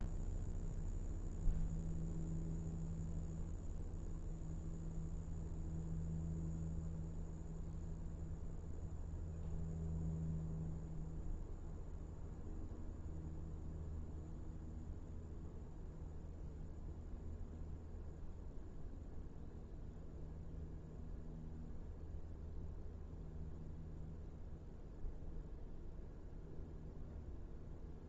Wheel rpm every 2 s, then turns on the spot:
0, 0, 0, 0, 0, 0, 0, 0, 0, 0, 0, 0, 0, 0.
none